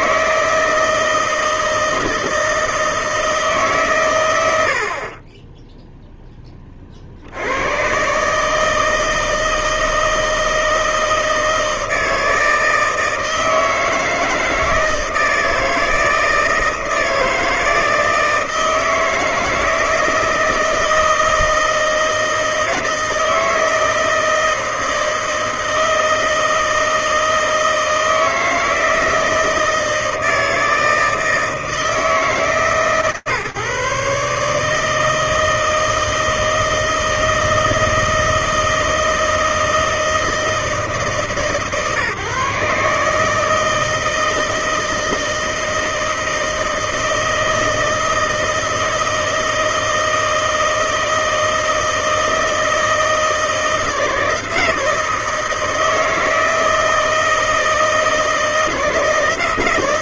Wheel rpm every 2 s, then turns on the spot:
160, 160, 120, 0, 130, 160, 160, 160, 160, 160, 160, 160, 160, 160, 160, 160, 160, 150, 160, 160, 160, 140, 160, 160, 160, 160, 160, 160, 160, 160.
none